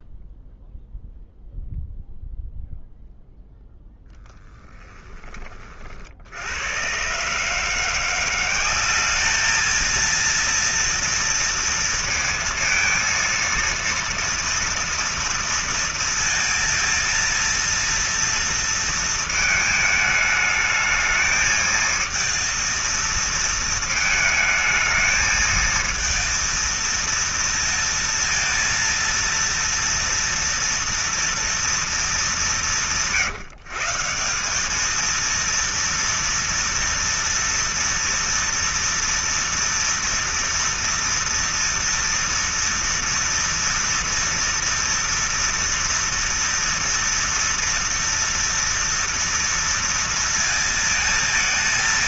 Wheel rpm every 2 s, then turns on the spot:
0, 0, 20, 60, 170, 220, 230, 230, 230, 230, 220, 230, 220, 230, 230, 230, 220, 170, 230, 230, 230, 230, 230, 230, 230, 230.
none